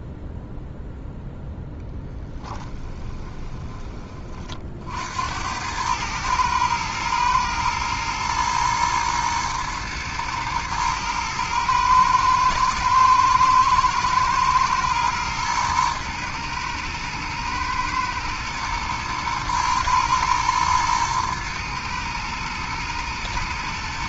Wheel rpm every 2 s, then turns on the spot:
0, 10, 60, 110, 120, 110, 110, 110, 110, 120, 120, 120.
2-4